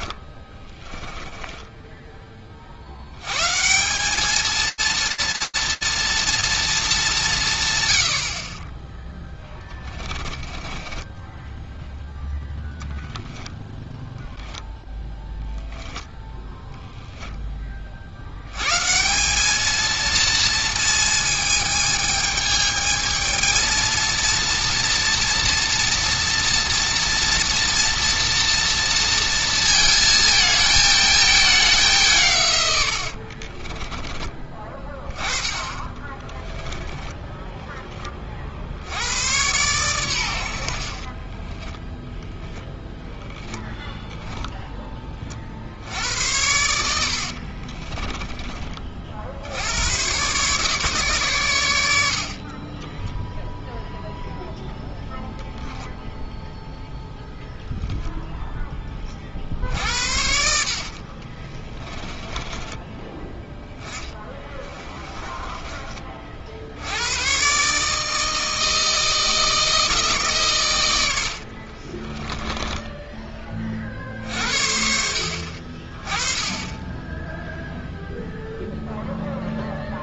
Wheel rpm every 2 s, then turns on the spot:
10, 150, 230, 180, 10, 10, 10, 0, 10, 180, 220, 220, 240, 240, 230, 220, 60, 20, 10, 80, 50, 0, 10, 80, 30, 140, 30, 0, 0, 10, 70, 20, 20, 50, 160, 130, 10, 60, 20, 0.
0-2 8-12 32-34 36-38 40-42 62-66 72-74